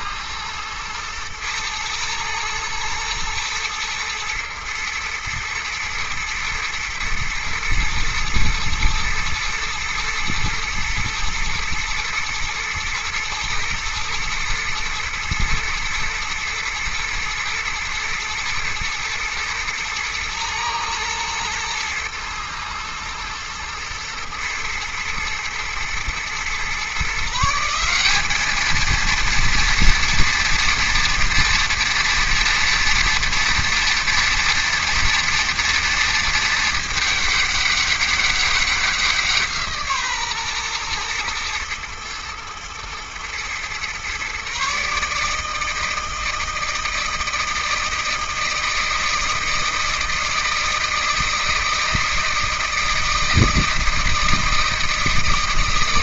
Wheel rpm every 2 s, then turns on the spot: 120, 110, 120, 120, 110, 110, 120, 110, 110, 110, 120, 120, 110, 140, 220, 230, 230, 230, 210, 190, 120, 110, 140, 160, 160, 160, 160, 160.
none